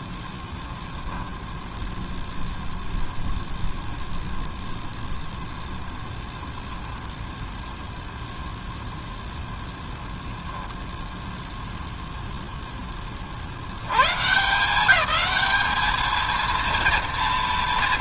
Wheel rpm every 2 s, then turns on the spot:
0, 0, 0, 0, 0, 0, 60, 210, 230.
none